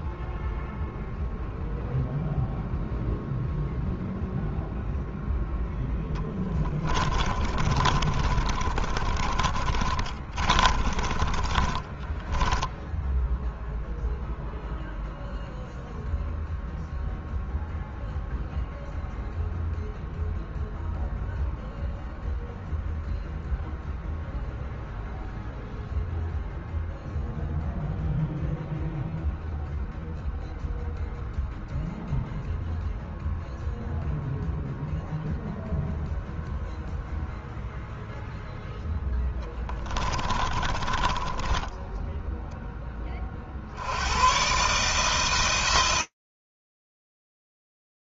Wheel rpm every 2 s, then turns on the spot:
0, 0, 0, 20, 30, 20, 0, 0, 0, 0, 0, 0, 0, 0, 0, 0, 0, 0, 0, 10, 20, 20, 130, 10.
6-12 40-42